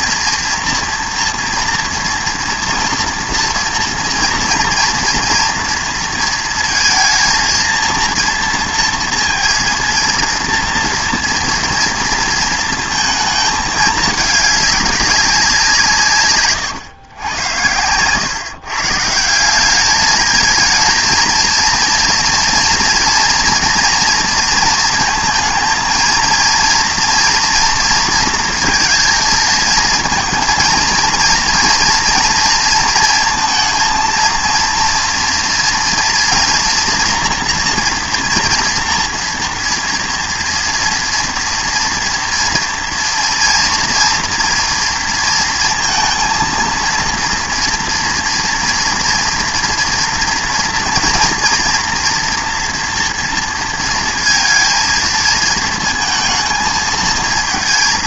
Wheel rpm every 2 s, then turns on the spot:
230, 240, 230, 220, 230, 230, 230, 210, 120, 140, 220, 230, 230, 230, 230, 230, 230, 230, 230, 230, 230, 230, 230, 230, 230, 230, 230, 230, 230.
none